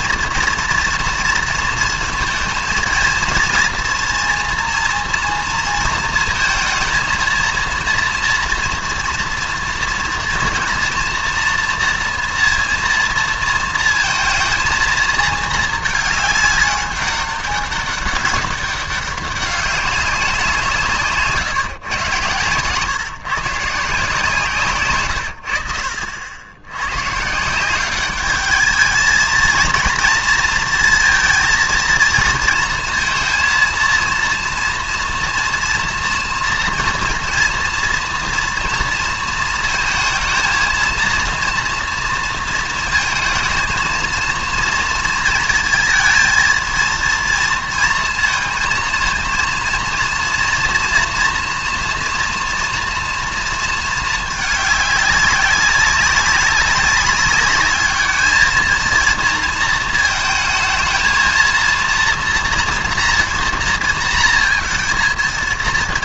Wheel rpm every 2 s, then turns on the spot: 230, 230, 240, 230, 240, 230, 230, 230, 200, 200, 160, 130, 150, 80, 210, 230, 230, 240, 230, 230, 230, 230, 230, 230, 230, 230, 230, 210, 190, 220, 220, 240, 230.
24-26